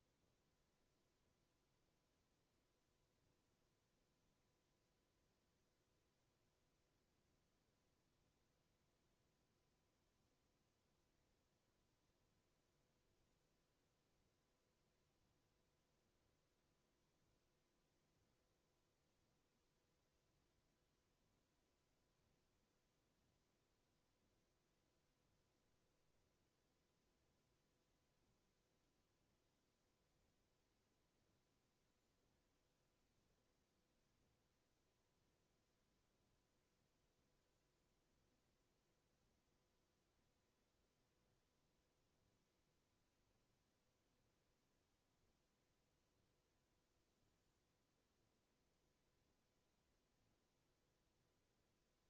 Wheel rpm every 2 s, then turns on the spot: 0, 0, 0, 0, 0, 0, 0, 0, 0, 0, 0, 0, 0, 0, 0, 0, 0, 0, 0, 0, 0, 0, 0, 0, 0, 0.
none